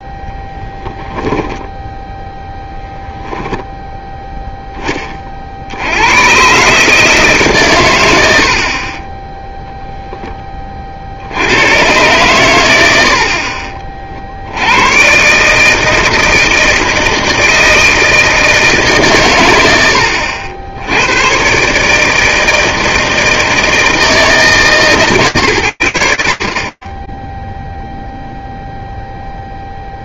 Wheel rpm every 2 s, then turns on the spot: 0, 0, 10, 130, 50, 30, 90, 80, 160, 150, 80, 160, 160, 30, 0.
none